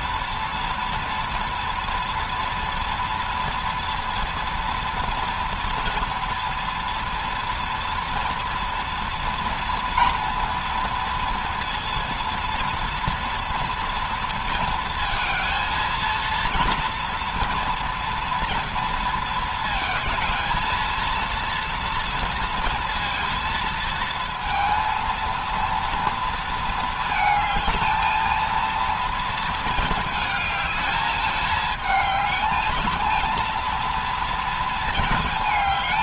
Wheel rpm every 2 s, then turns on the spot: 230, 230, 230, 230, 230, 230, 230, 230, 230, 230, 230, 230, 230, 220, 220, 210, 220, 220.
none